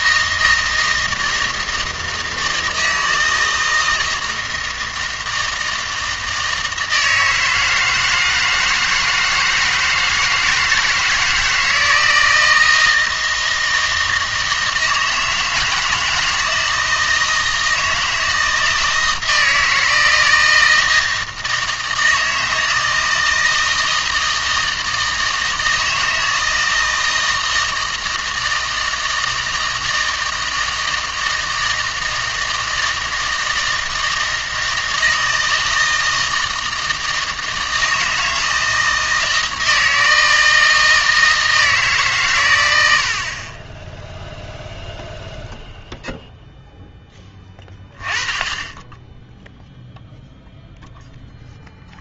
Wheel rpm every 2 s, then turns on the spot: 160, 160, 160, 160, 160, 160, 160, 160, 160, 160, 160, 160, 160, 160, 160, 160, 160, 160, 160, 160, 160, 90, 0, 10, 10, 0.
none